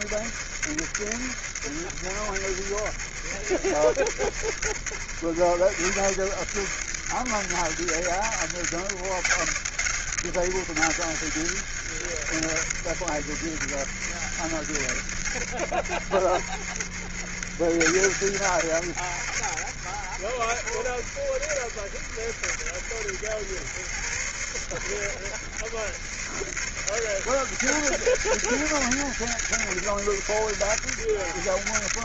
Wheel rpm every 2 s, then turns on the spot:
70, 70, 70, 80, 80, 90, 70, 70, 70, 70, 60, 60, 60, 80, 100, 80.
none